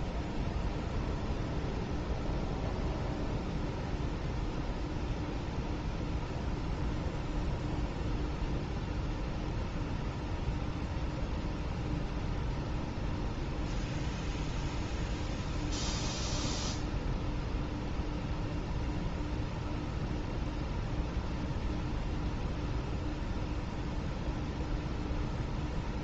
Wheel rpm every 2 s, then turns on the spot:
0, 0, 0, 0, 0, 0, 0, 0, 0, 0, 0, 0, 0.
none